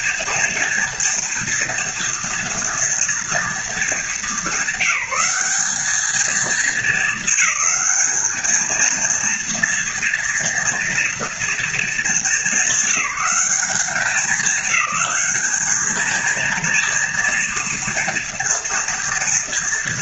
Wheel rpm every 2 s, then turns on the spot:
230, 230, 200, 220, 230, 240, 200, 200, 230, 240.
none